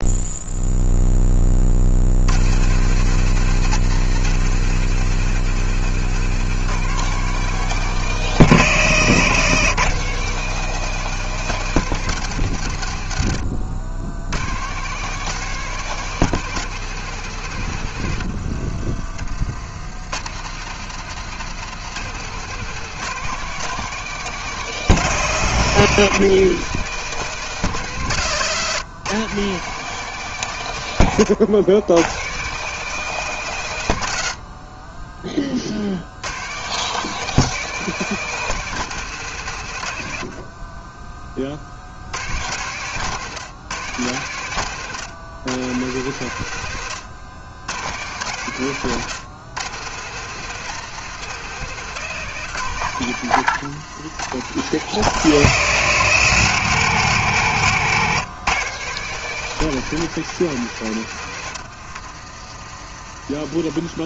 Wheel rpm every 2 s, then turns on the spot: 20, 150, 160, 170, 140, 170, 90, 160, 150, 40, 160, 160, 150, 170, 150, 110, 170, 30, 170, 160, 30, 140, 120, 110, 130, 160, 130, 140, 150, 160, 110, 40.
none